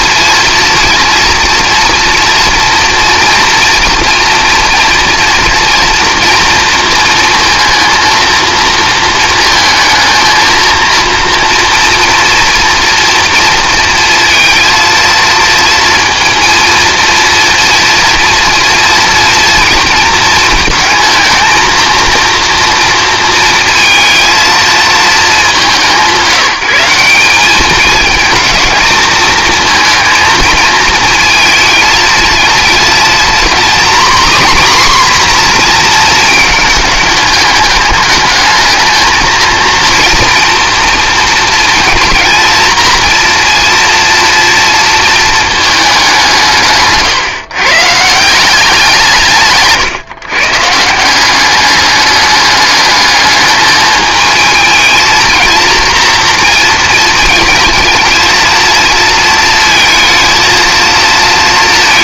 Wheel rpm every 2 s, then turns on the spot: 230, 230, 230, 230, 230, 230, 240, 230, 230, 230, 220, 230, 220, 180, 220, 220, 230, 260, 210, 220, 240, 230, 230, 150, 180, 160, 210, 220, 230, 230, 230.
46-48